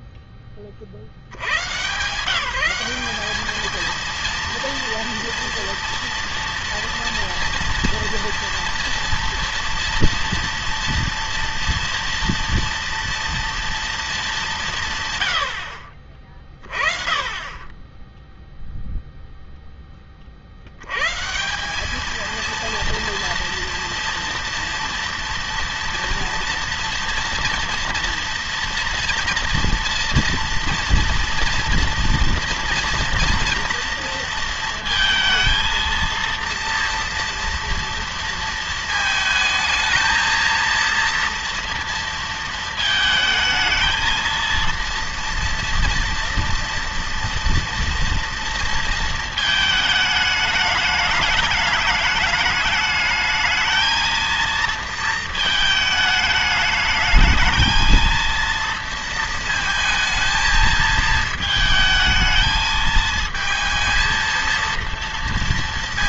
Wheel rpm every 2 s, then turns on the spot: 40, 180, 230, 230, 230, 230, 230, 160, 20, 0, 100, 230, 230, 240, 240, 230, 230, 230, 230, 230, 230, 220, 230, 230, 230, 210, 210, 230, 220, 230, 220, 220, 230.
none